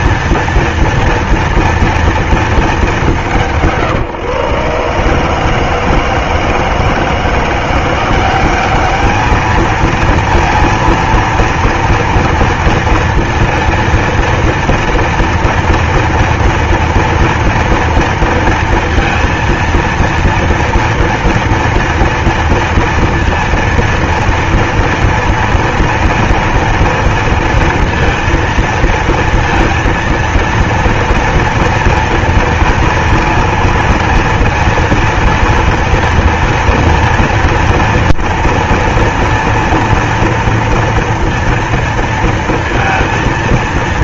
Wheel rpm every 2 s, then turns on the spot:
230, 230, 150, 160, 180, 230, 230, 230, 240, 230, 230, 230, 230, 230, 230, 230, 230, 230, 230, 230, 230, 230.
none